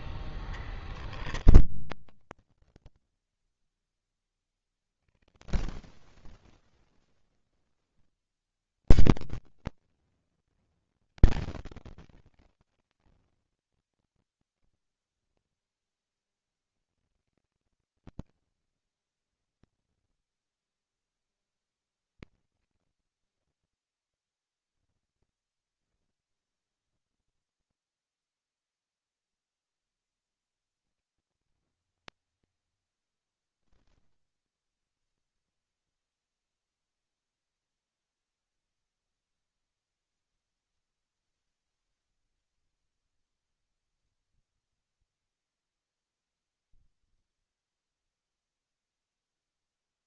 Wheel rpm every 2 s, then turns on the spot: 10, 20, 30, 10, 170, 230, 200, 40, 160, 40, 40, 60, 20, 20, 10, 140, 20, 10, 0, 0, 0, 10, 20, 10, 0.
0-6 14-16 18-20 26-28 42-46